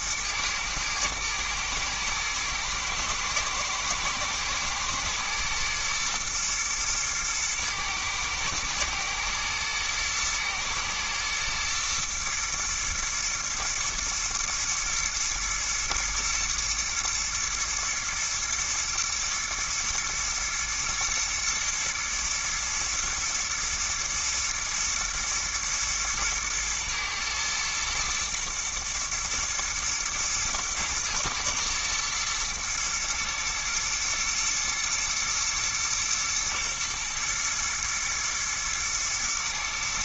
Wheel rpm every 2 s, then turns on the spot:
110, 120, 110, 120, 110, 110, 120, 110, 110, 110, 110, 110, 110, 110, 120, 110, 120, 120, 110, 110.
none